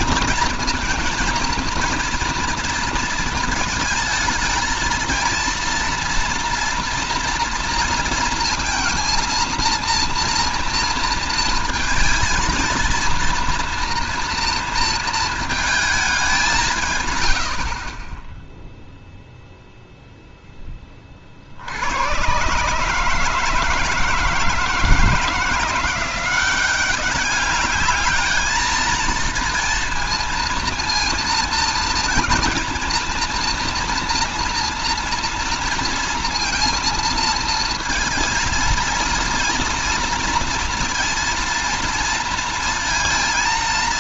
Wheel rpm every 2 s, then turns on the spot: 230, 230, 220, 240, 230, 230, 230, 230, 180, 10, 10, 130, 160, 180, 220, 230, 230, 230, 230, 230, 230, 230.
none